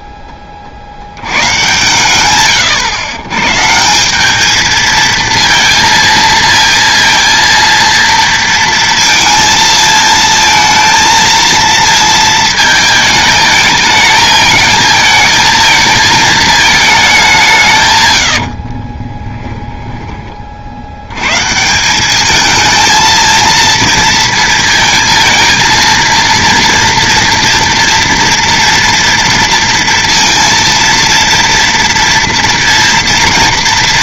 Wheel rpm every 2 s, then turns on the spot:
30, 100, 220, 230, 230, 230, 220, 220, 220, 50, 50, 220, 230, 230, 240, 230, 230.
18-20